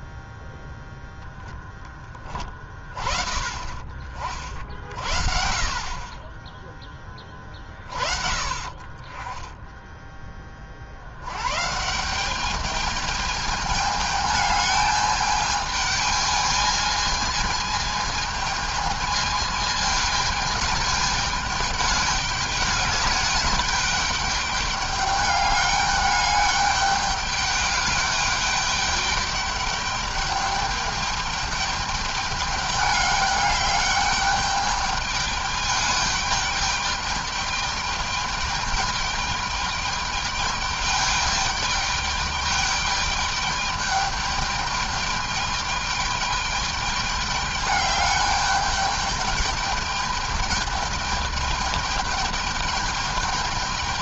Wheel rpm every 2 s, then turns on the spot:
0, 30, 50, 20, 40, 70, 210, 210, 220, 220, 210, 210, 210, 210, 210, 210, 210, 210, 210, 210, 210, 210, 210, 210, 210, 210, 210.
none